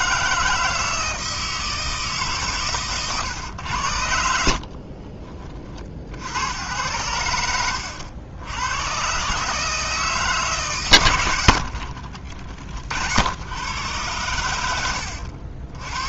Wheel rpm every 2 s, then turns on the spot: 160, 130, 60, 80, 90, 150, 50, 90.
4-6